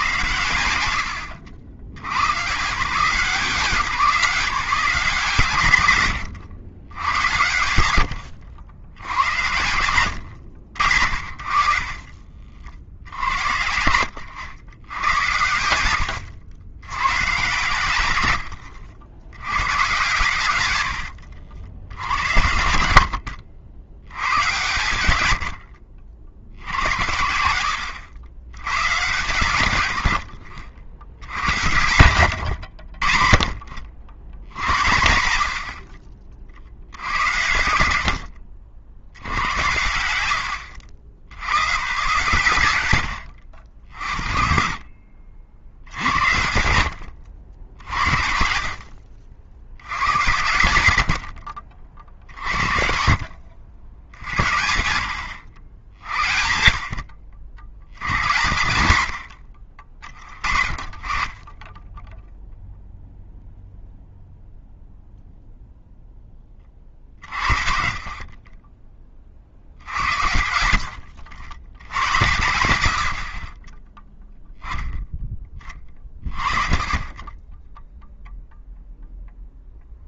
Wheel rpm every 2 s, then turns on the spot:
90, 140, 180, 100, 100, 90, 60, 90, 80, 100, 100, 80, 120, 90, 120, 70, 90, 90, 50, 60, 90, 110, 50, 90, 60, 100, 60, 80, 60, 100, 40, 0, 0, 30, 20, 80, 80, 0, 30, 0.
14-16 18-22 32-34 38-40 50-52 70-72